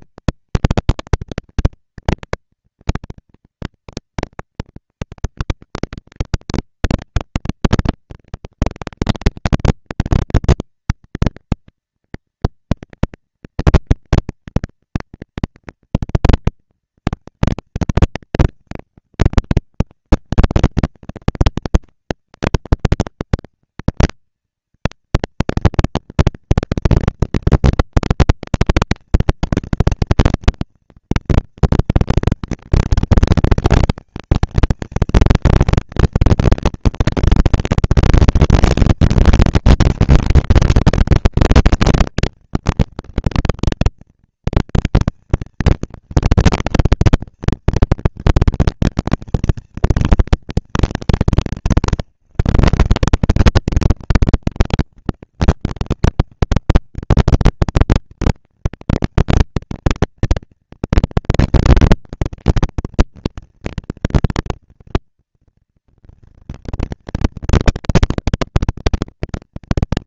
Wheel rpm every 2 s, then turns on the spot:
230, 230, 230, 230, 230, 230, 230, 230, 230, 200, 190, 200, 220, 230, 240, 230, 230, 220, 230, 230, 230, 230, 230, 230, 230, 210, 170, 190, 210, 220, 230, 230, 230, 230, 230.
none